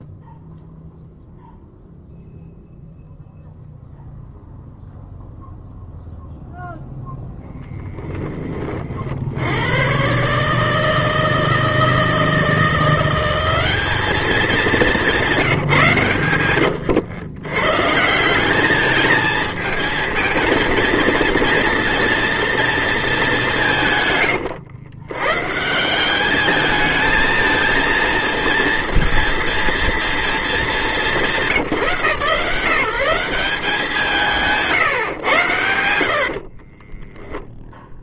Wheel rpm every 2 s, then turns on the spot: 0, 0, 0, 0, 30, 150, 170, 200, 120, 200, 230, 230, 110, 210, 230, 220, 160, 160, 40.
16-18 34-38